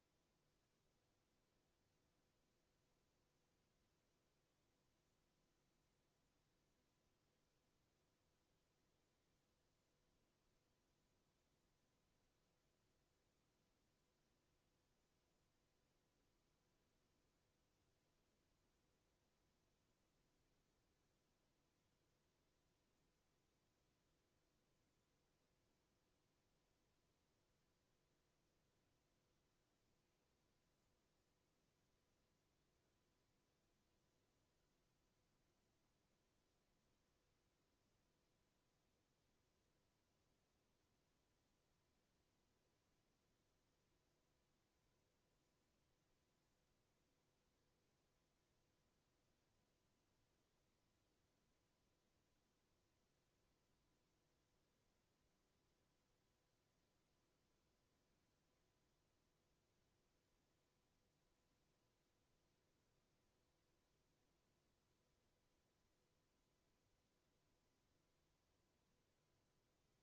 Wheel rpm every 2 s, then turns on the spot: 0, 0, 0, 0, 0, 0, 0, 0, 0, 0, 0, 0, 0, 0, 0, 0, 0, 0, 0, 0, 0, 0, 0, 0, 0, 0, 0, 0, 0, 0, 0, 0, 0, 0, 0.
none